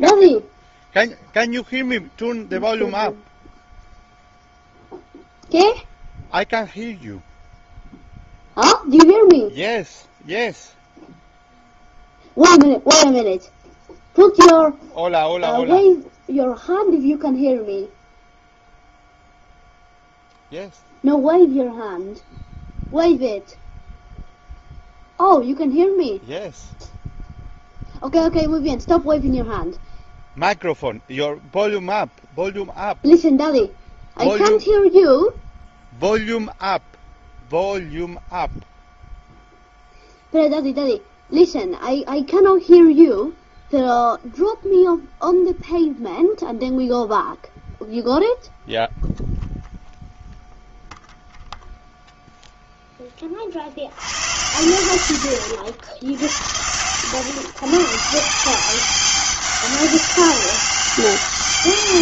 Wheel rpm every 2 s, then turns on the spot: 0, 0, 0, 0, 0, 0, 0, 0, 0, 0, 0, 0, 0, 0, 0, 0, 0, 0, 0, 0, 0, 0, 0, 0, 0, 0, 0, 90, 80, 180, 190.
none